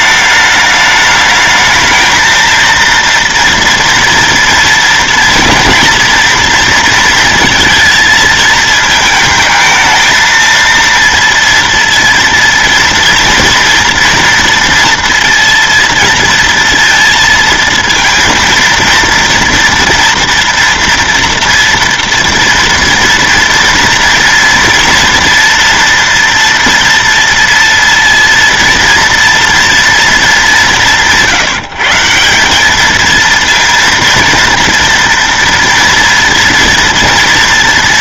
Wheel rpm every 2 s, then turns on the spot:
210, 230, 230, 230, 220, 230, 230, 230, 230, 230, 230, 230, 230, 230, 230, 190, 210, 230, 230.
none